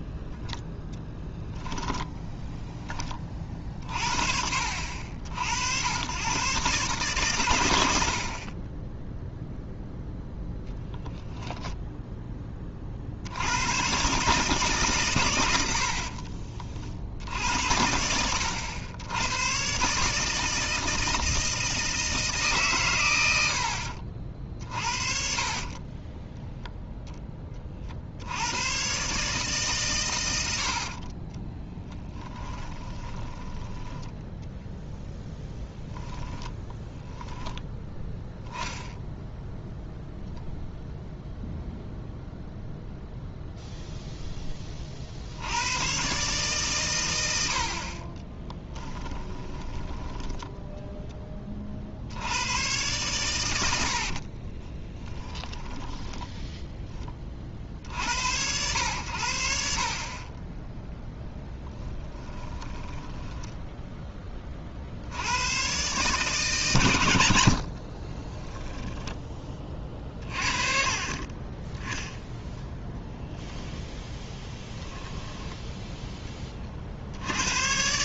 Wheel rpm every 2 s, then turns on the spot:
0, 10, 50, 130, 30, 0, 20, 140, 40, 90, 160, 140, 50, 0, 90, 90, 10, 10, 10, 0, 0, 0, 30, 130, 10, 10, 100, 30, 10, 90, 10, 20, 40, 130, 20, 30, 0, 10, 0.
16-18 32-34 36-38 48-52 54-56 62-64 68-70 74-76